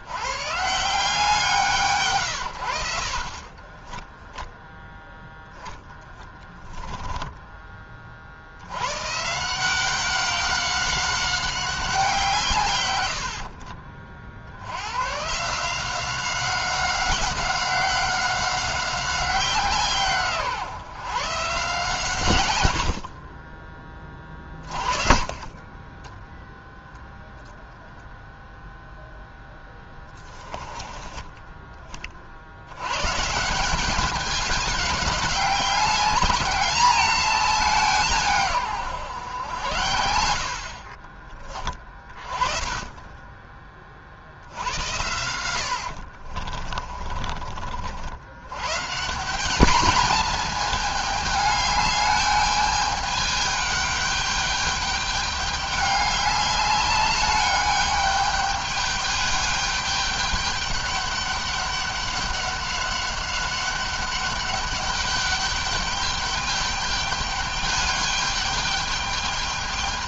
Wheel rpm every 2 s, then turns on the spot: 140, 70, 0, 10, 110, 190, 110, 100, 190, 180, 140, 70, 30, 0, 0, 10, 120, 200, 210, 130, 40, 20, 90, 40, 160, 220, 210, 210, 200, 210, 200, 190, 200, 210, 210.
6-8 22-26 40-42 46-48